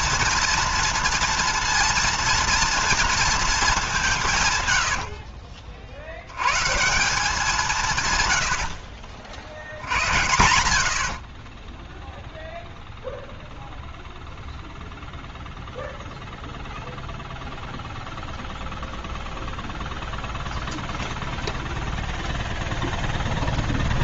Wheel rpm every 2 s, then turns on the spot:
230, 230, 150, 120, 80, 70, 0, 0, 0, 0, 0, 0.
4-6 10-12